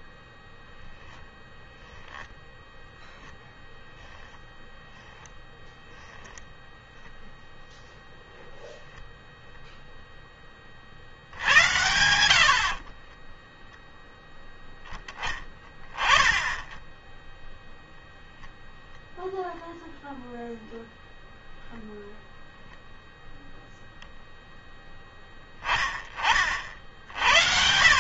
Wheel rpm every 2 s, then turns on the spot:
0, 0, 10, 0, 0, 10, 70, 0, 10, 0, 0, 0, 0, 40.
none